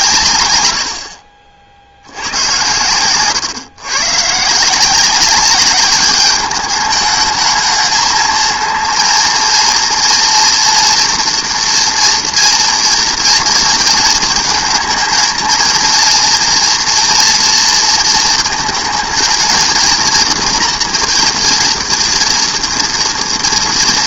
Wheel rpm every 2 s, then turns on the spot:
60, 130, 200, 220, 230, 230, 230, 230, 230, 230, 240, 230.
none